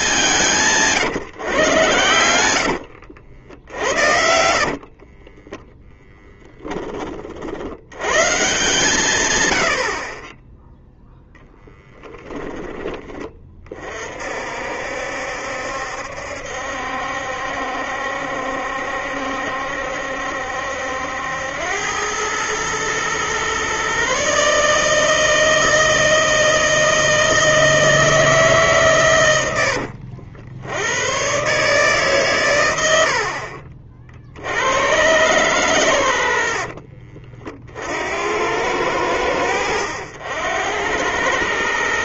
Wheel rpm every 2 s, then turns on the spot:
140, 70, 30, 20, 150, 0, 20, 60, 70, 70, 80, 110, 150, 160, 130, 90, 90, 110, 40, 90, 90.
2-6 32-34 36-38